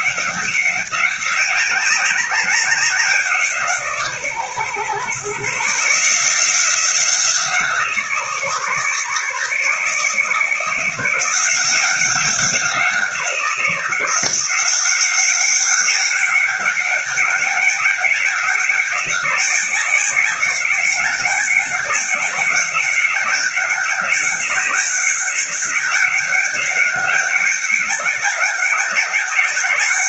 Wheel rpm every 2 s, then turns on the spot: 190, 180, 120, 180, 150, 170, 180, 180, 190, 190, 190, 190, 200, 190, 200.
none